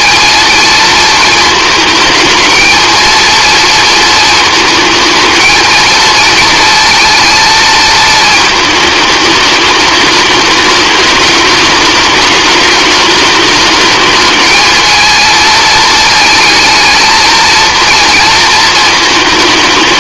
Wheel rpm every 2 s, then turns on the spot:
230, 230, 220, 230, 210, 210, 210, 220, 220, 220.
none